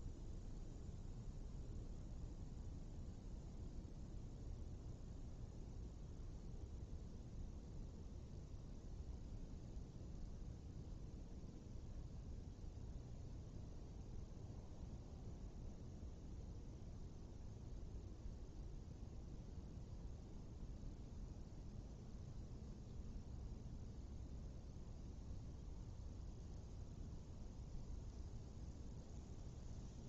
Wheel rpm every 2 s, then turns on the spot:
0, 0, 0, 0, 0, 0, 0, 0, 0, 0, 0, 0, 0, 0, 0.
none